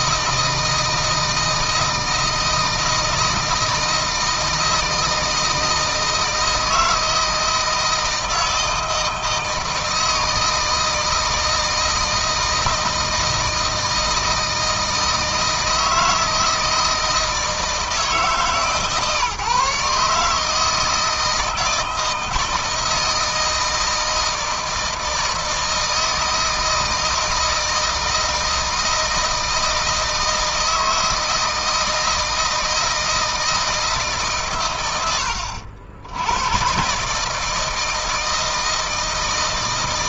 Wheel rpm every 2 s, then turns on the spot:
160, 160, 160, 160, 160, 160, 160, 160, 160, 140, 160, 160, 160, 160, 160, 160, 160, 120, 120, 160.
none